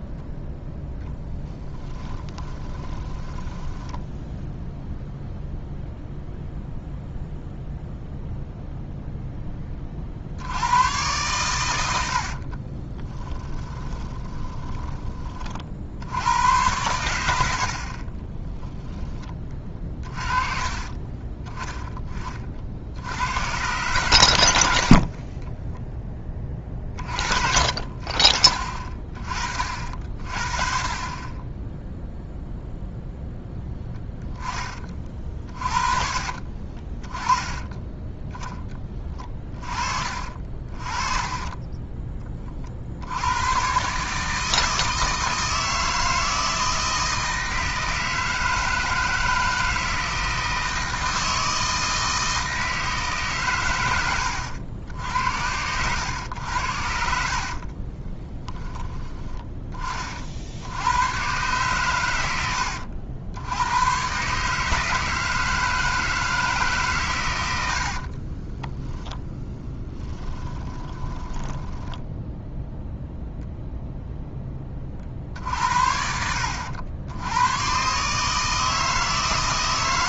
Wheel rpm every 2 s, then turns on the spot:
0, 20, 0, 0, 0, 80, 50, 10, 100, 10, 30, 40, 80, 20, 40, 40, 0, 20, 40, 10, 40, 40, 160, 160, 160, 160, 160, 80, 90, 20, 60, 90, 150, 150, 20, 20, 0, 10, 80, 160.
2-4 12-16 18-20 36-38 40-42 58-60 68-72